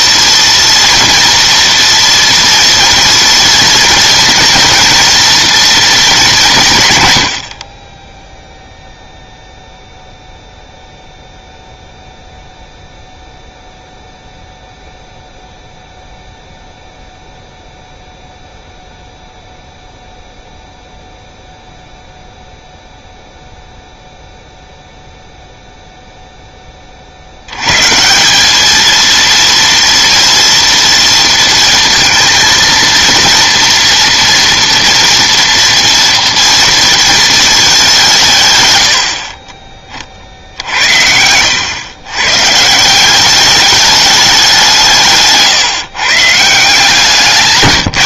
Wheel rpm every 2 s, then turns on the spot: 230, 230, 230, 140, 0, 0, 0, 0, 0, 0, 0, 0, 0, 20, 210, 230, 230, 230, 230, 120, 70, 160, 170, 160.
none